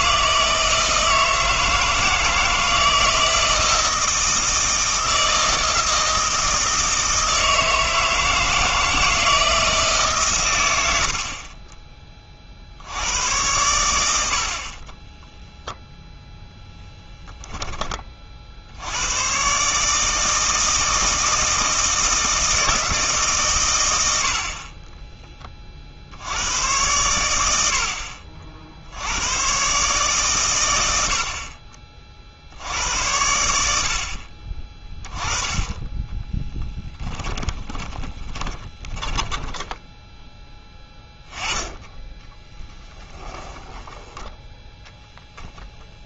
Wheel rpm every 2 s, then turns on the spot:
160, 160, 160, 160, 160, 100, 60, 40, 0, 70, 160, 160, 30, 110, 70, 100, 80, 30, 10, 10, 10, 20, 10.
36-40 42-46